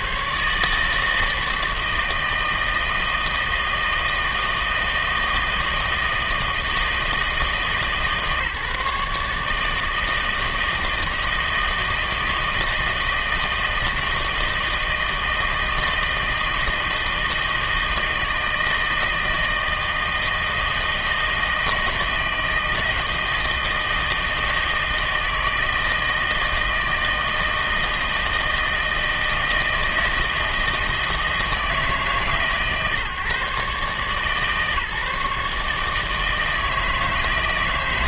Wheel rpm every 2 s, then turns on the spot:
150, 160, 160, 160, 150, 160, 160, 160, 160, 160, 160, 160, 160, 160, 160, 160, 130, 150, 160.
none